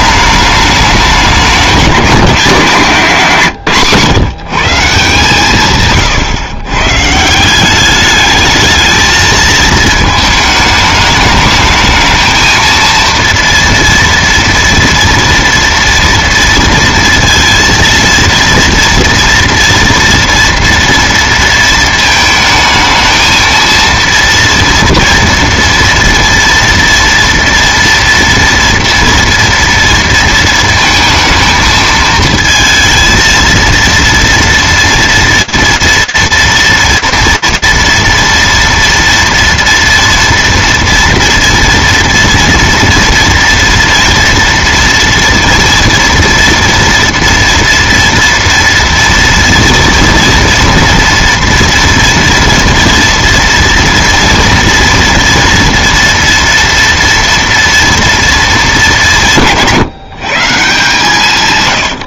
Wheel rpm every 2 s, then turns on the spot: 210, 190, 160, 130, 210, 220, 220, 230, 230, 230, 240, 220, 230, 230, 230, 230, 220, 230, 230, 230, 240, 230, 230, 230, 230, 230, 230, 230, 230, 210, 140.
none